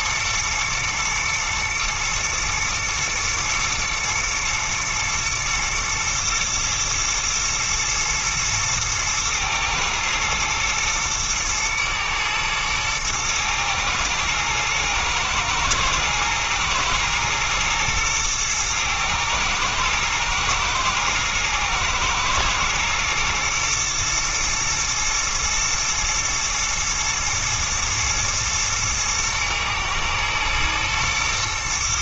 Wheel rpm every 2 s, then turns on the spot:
120, 110, 110, 110, 110, 110, 110, 110, 120, 110, 110, 110, 120, 110, 110, 120.
none